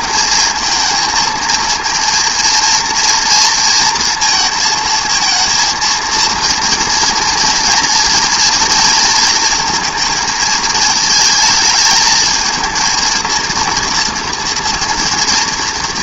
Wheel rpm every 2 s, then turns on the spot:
220, 230, 230, 230, 230, 220, 230, 230.
none